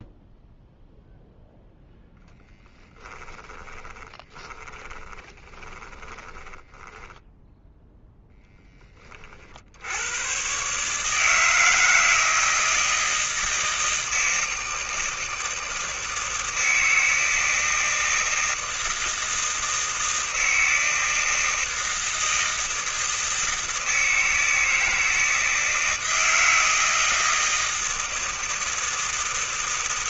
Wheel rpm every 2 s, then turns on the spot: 0, 10, 20, 10, 20, 150, 160, 160, 160, 160, 160, 160, 160, 160, 160.
2-8